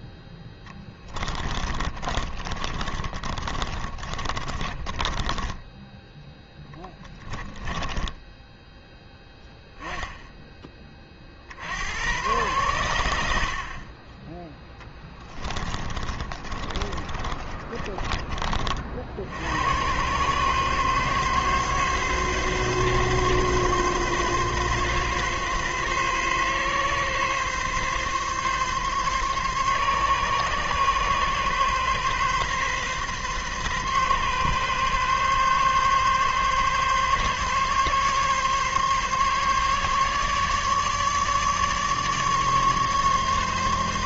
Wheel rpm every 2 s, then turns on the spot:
10, 30, 30, 10, 10, 20, 100, 10, 30, 50, 130, 140, 140, 140, 140, 140, 130, 130, 140, 140, 150, 150.
0-8 14-18